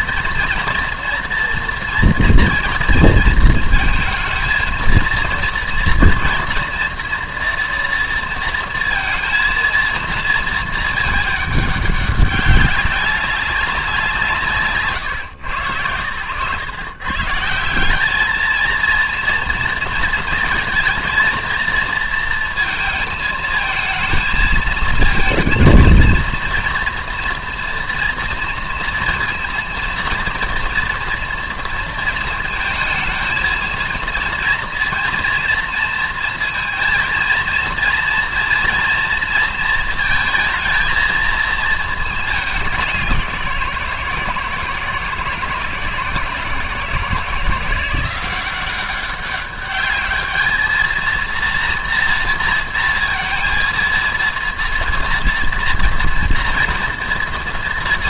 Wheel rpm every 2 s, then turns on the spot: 230, 230, 220, 230, 230, 220, 190, 150, 120, 220, 230, 230, 220, 230, 230, 230, 230, 230, 230, 240, 220, 200, 160, 160, 180, 220, 230, 230, 230.
none